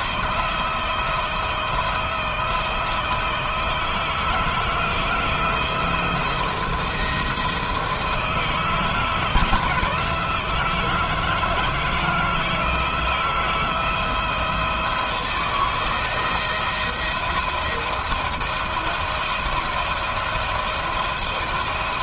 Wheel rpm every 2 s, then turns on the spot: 160, 160, 160, 170, 160, 160, 160, 160, 170, 160, 170.
none